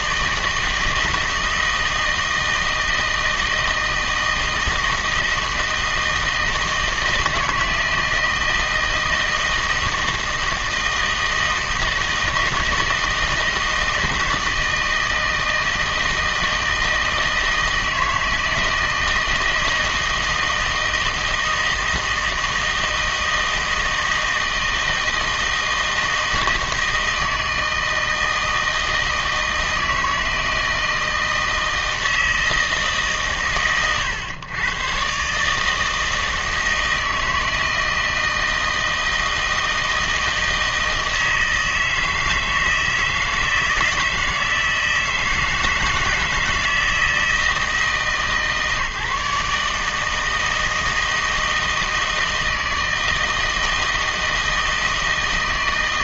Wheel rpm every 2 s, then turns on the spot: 160, 160, 160, 160, 160, 160, 160, 160, 160, 160, 160, 160, 160, 160, 160, 160, 160, 120, 160, 160, 160, 160, 160, 160, 150, 160, 160, 160.
none